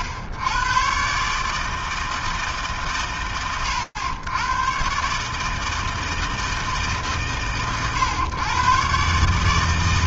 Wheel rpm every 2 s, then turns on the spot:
100, 160, 110, 160, 110.
none